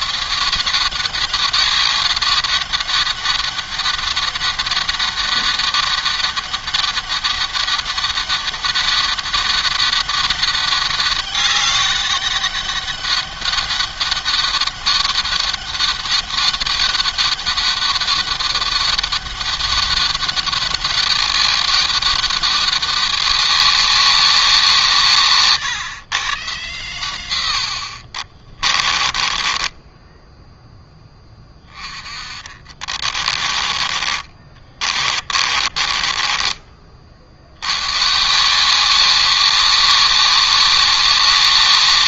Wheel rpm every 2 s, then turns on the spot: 190, 200, 200, 200, 200, 200, 200, 200, 200, 200, 200, 190, 150, 110, 30, 10, 30, 30, 40, 190, 200.
28-30 32-36